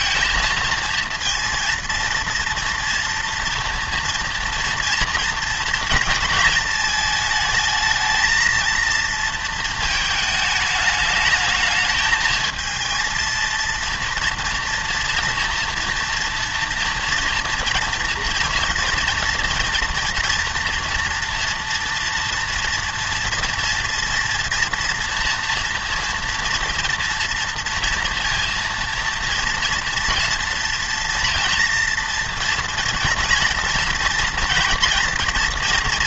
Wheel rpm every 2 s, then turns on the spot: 230, 230, 230, 220, 230, 220, 220, 230, 230, 230, 240, 230, 230, 230, 230, 230, 230, 230.
none